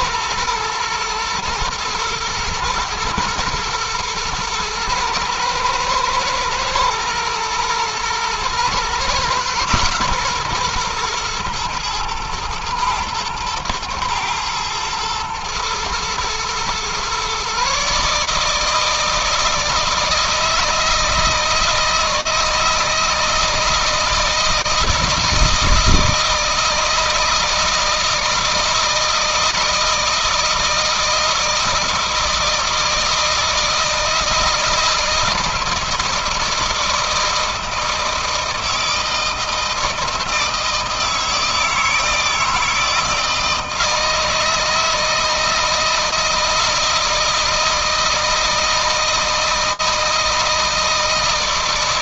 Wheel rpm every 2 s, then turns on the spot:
110, 120, 120, 110, 120, 130, 120, 110, 120, 150, 160, 160, 160, 160, 160, 160, 160, 160, 160, 160, 160, 160, 160, 160, 160, 160.
none